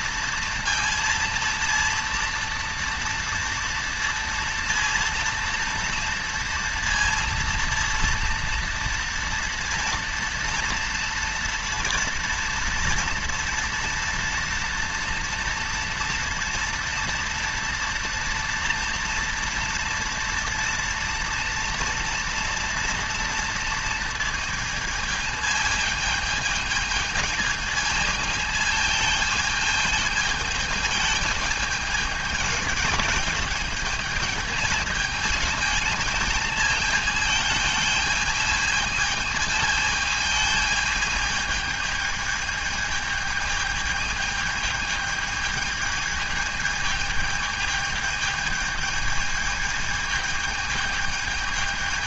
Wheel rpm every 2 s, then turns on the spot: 230, 230, 230, 230, 230, 230, 230, 230, 230, 230, 230, 230, 220, 220, 220, 220, 220, 220, 220, 220, 220, 220, 220, 220, 220, 220.
none